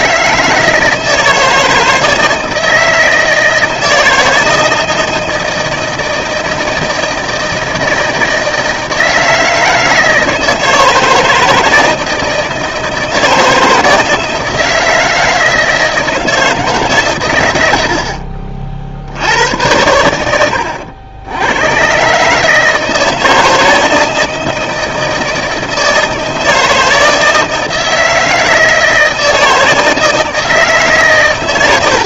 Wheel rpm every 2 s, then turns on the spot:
160, 160, 160, 160, 160, 160, 160, 160, 160, 50, 90, 150, 160, 160, 160, 150.
none